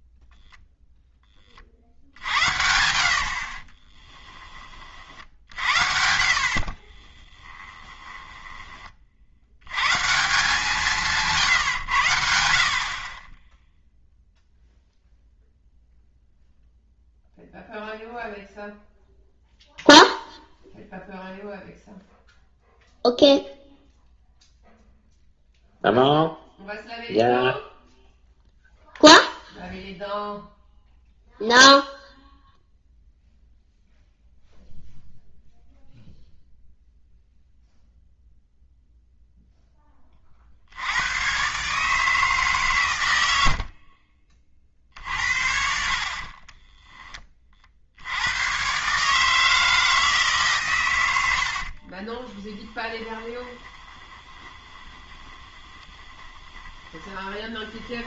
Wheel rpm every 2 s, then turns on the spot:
0, 80, 30, 40, 20, 170, 60, 0, 0, 0, 0, 0, 0, 0, 0, 0, 0, 0, 0, 0, 70, 130, 50, 20, 130, 130, 10, 20, 20.
2-4 6-8 46-48 52-58